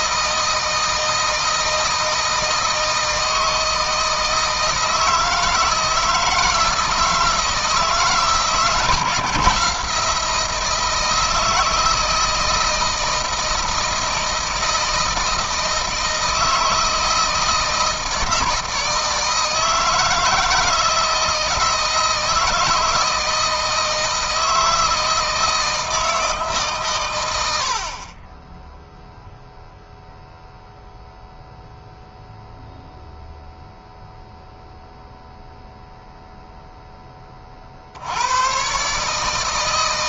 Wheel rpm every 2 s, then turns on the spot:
160, 160, 160, 160, 160, 170, 160, 160, 160, 160, 160, 160, 160, 140, 10, 0, 0, 0, 0, 120.
none